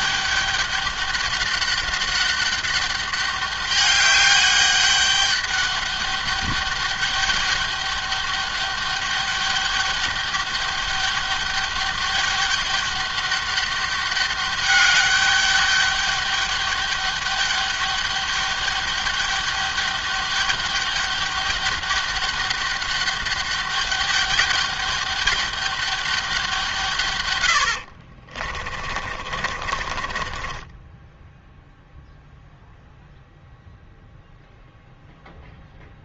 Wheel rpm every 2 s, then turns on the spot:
200, 200, 200, 200, 200, 200, 200, 200, 200, 200, 200, 200, 200, 180, 40, 20, 0, 0.
28-32